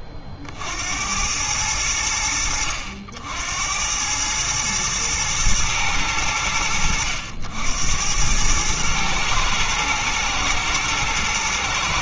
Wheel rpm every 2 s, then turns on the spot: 30, 60, 110, 80, 110, 110.
none